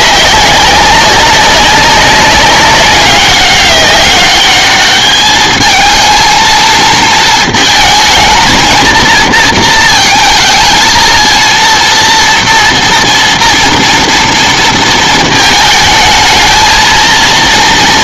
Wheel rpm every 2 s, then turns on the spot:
200, 190, 210, 220, 230, 230, 230, 230, 220.
none